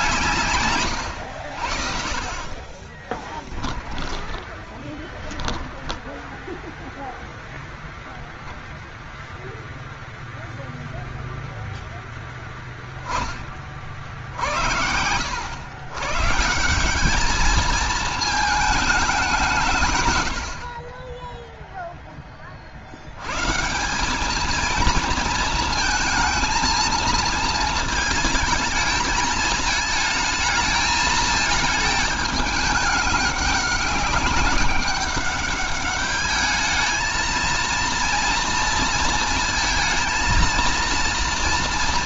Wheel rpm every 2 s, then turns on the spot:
130, 30, 10, 0, 0, 0, 10, 80, 180, 210, 40, 100, 230, 230, 220, 230, 210, 200, 220, 230, 230.
2-6